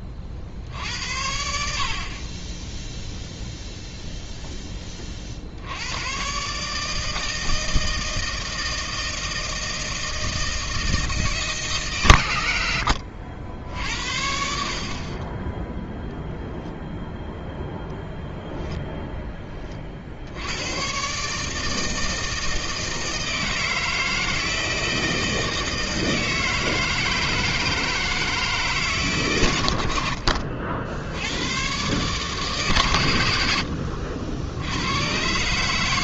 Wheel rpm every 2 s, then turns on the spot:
60, 10, 10, 140, 160, 160, 100, 60, 0, 0, 90, 160, 160, 160, 150, 60, 140, 80.
none